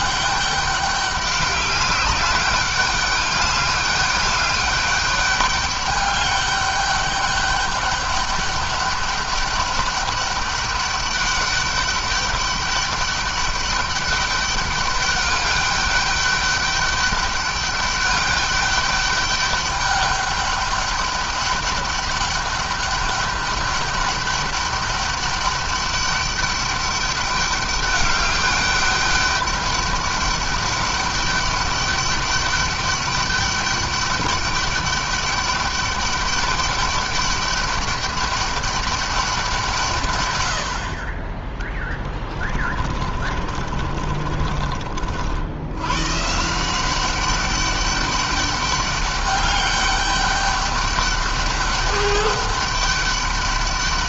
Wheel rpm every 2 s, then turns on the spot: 200, 200, 200, 200, 200, 200, 200, 200, 200, 200, 200, 200, 200, 200, 200, 200, 200, 200, 200, 200, 70, 30, 50, 180, 200, 200, 200.
42-44